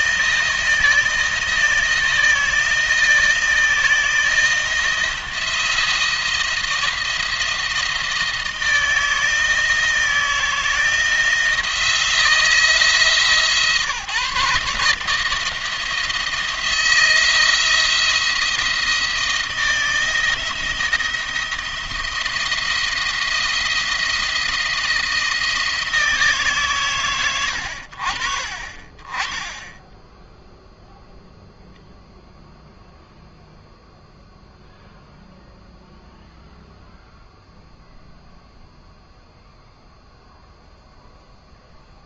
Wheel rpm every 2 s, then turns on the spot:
160, 160, 170, 170, 160, 160, 160, 150, 160, 170, 160, 170, 170, 150, 40, 0, 0, 0, 0, 0, 0.
none